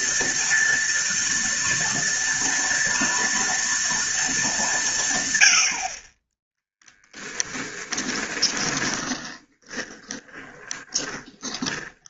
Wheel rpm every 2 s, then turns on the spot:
230, 230, 180, 10, 20, 30.
8-12